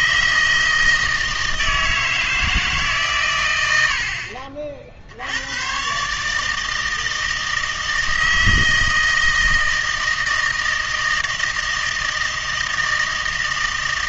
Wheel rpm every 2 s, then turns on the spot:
160, 150, 40, 160, 160, 160, 160.
none